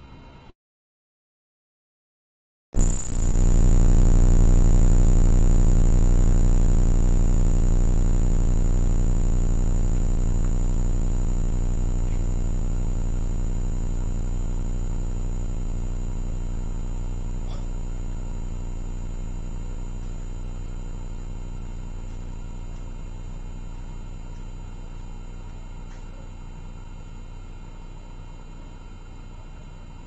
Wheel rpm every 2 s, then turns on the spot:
0, 0, 0, 0, 0, 0, 0, 0, 0, 0, 0, 0, 0, 0, 0.
none